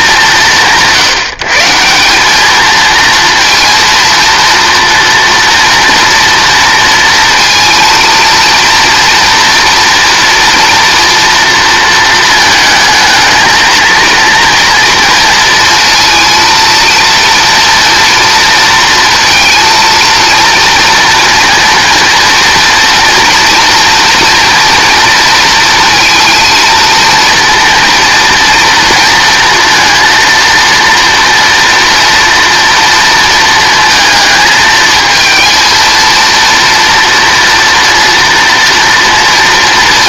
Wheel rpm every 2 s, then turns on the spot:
170, 220, 230, 230, 230, 240, 220, 240, 230, 230, 230, 230, 240, 230, 230, 230, 230, 220, 230, 230.
none